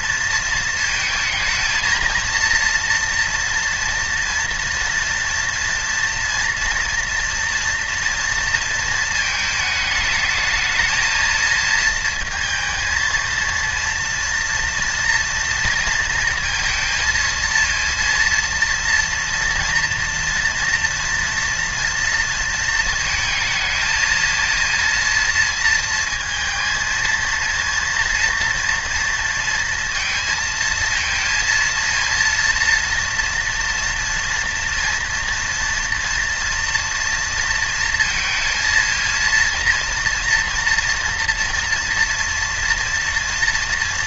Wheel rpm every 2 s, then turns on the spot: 230, 230, 230, 230, 230, 220, 230, 230, 230, 230, 240, 230, 230, 230, 230, 230, 230, 230, 230, 220, 230, 230.
none